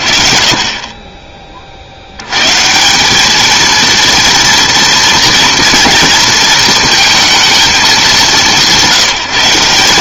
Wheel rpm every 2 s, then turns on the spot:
30, 150, 230, 230, 190.
none